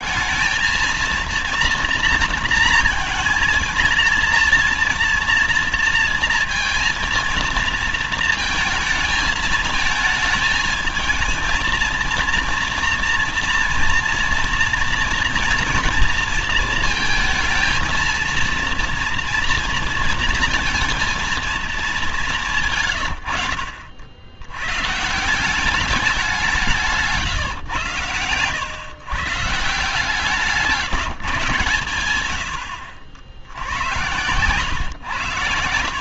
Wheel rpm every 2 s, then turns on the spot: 220, 230, 230, 230, 220, 220, 230, 230, 230, 230, 230, 150, 110, 180, 130, 160, 90, 110.
none